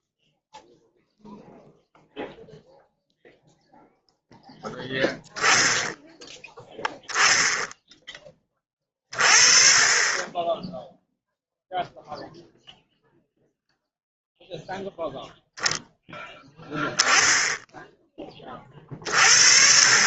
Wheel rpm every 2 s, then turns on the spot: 0, 0, 10, 20, 10, 0, 0, 10, 30, 30.
none